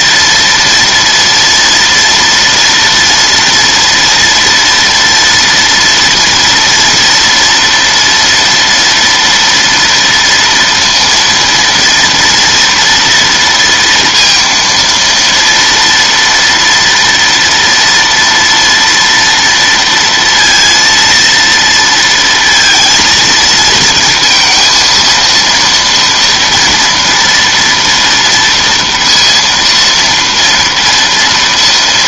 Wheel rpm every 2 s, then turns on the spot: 230, 240, 230, 230, 230, 230, 230, 230, 230, 230, 230, 230, 230, 240, 230, 230.
none